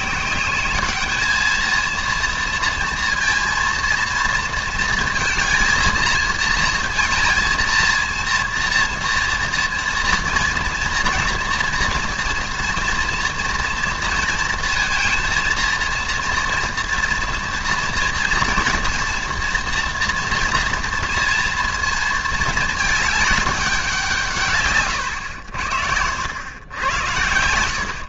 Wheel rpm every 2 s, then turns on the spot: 200, 230, 230, 230, 230, 230, 240, 230, 230, 240, 230, 220, 130, 100.
none